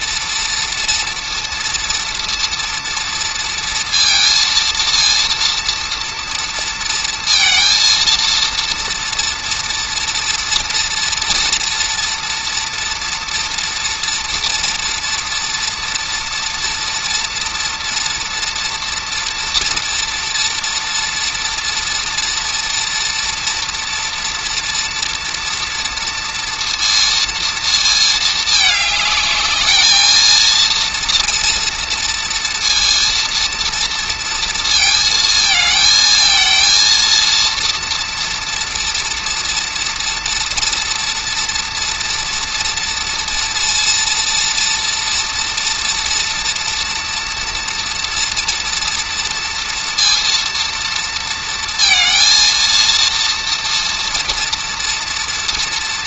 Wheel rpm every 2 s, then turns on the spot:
230, 230, 230, 230, 230, 230, 230, 230, 230, 240, 240, 240, 230, 230, 210, 230, 230, 230, 230, 230, 240, 230, 230, 240, 230, 230, 230, 230.
none